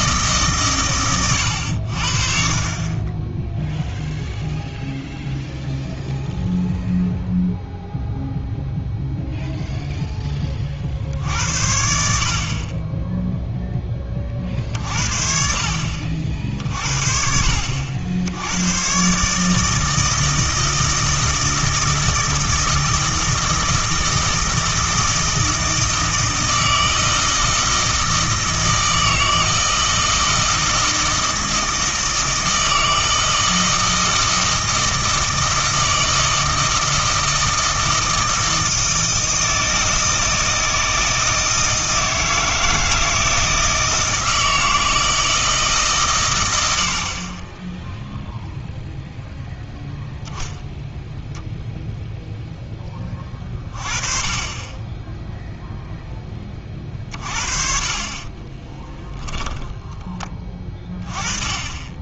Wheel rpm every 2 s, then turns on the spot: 130, 40, 0, 0, 0, 50, 30, 50, 50, 100, 160, 160, 160, 160, 160, 160, 160, 160, 160, 160, 160, 160, 160, 90, 0, 0, 10, 20, 30, 20, 20.
58-60